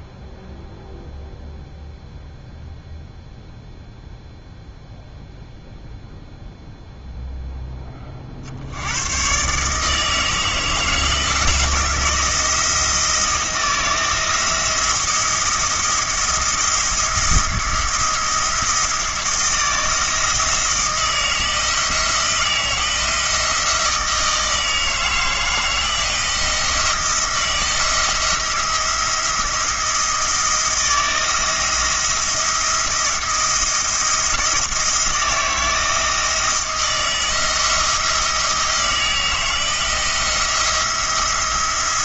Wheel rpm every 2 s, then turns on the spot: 0, 0, 0, 0, 90, 160, 160, 170, 170, 170, 160, 170, 160, 170, 170, 170, 170, 160, 160, 160, 170.
none